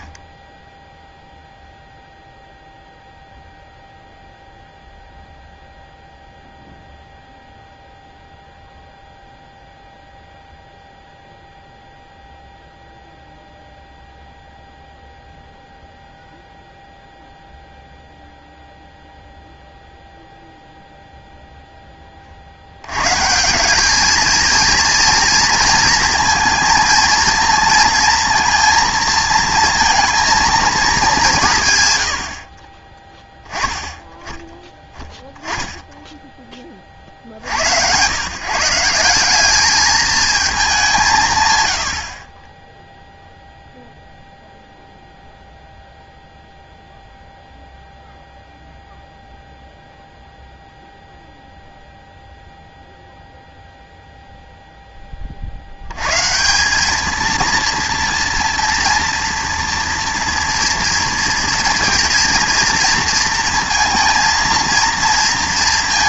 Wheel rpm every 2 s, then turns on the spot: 10, 0, 0, 0, 0, 0, 0, 0, 0, 0, 0, 80, 230, 230, 230, 220, 30, 10, 40, 170, 200, 10, 0, 0, 0, 0, 0, 0, 190, 230, 230, 230, 230.
none